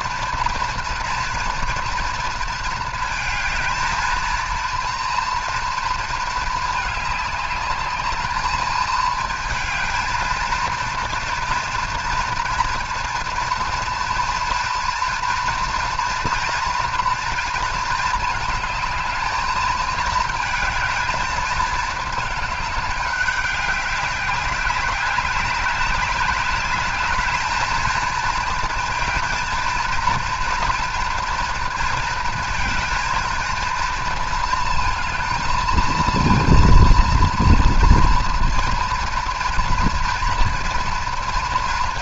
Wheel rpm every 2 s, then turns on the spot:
240, 230, 230, 210, 220, 230, 230, 230, 230, 220, 220, 210, 200, 210, 230, 230, 220, 230, 230, 230, 230.
none